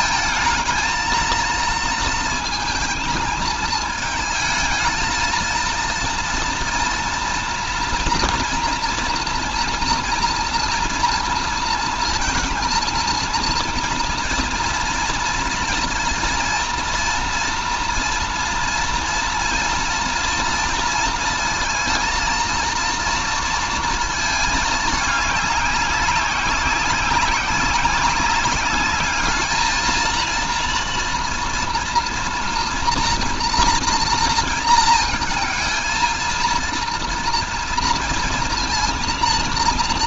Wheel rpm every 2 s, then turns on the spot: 220, 230, 220, 230, 240, 230, 230, 230, 230, 230, 230, 230, 220, 190, 200, 230, 230, 230, 230, 230.
none